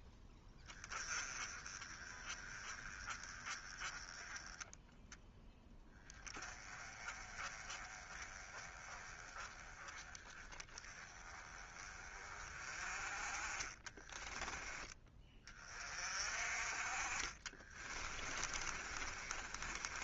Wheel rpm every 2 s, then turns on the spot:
10, 20, 10, 20, 20, 20, 30, 10, 30, 30.
18-20